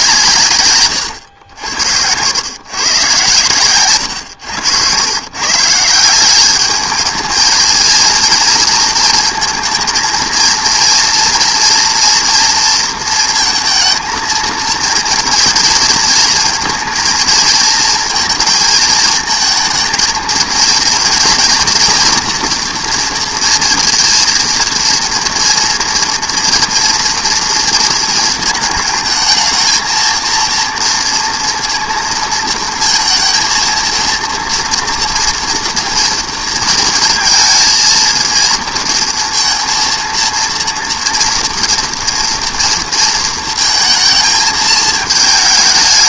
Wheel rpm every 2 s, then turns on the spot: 140, 110, 110, 200, 230, 230, 230, 230, 230, 220, 230, 240, 230, 230, 220, 230, 230, 230, 230, 230, 230, 230, 220.
none